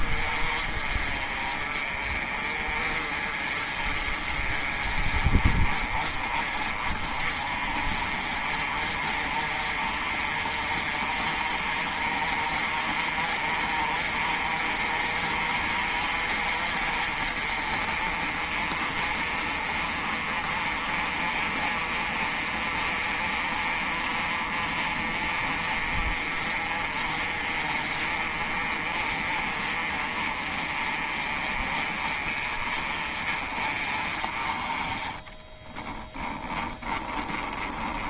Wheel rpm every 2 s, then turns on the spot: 40, 40, 30, 30, 40, 40, 40, 40, 40, 40, 40, 40, 40, 40, 40, 30, 30, 20, 20.
36-38